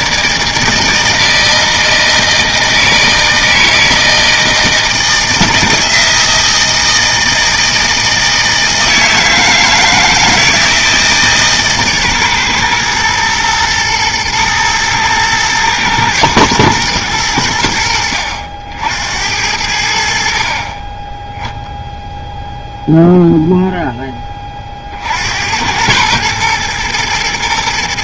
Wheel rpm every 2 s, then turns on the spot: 160, 160, 160, 160, 160, 160, 120, 110, 110, 70, 40, 0, 40, 120.
none